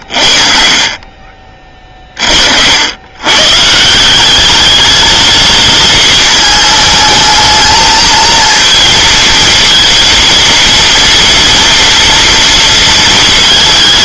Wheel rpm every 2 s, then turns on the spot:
50, 70, 210, 220, 230, 230, 230.
none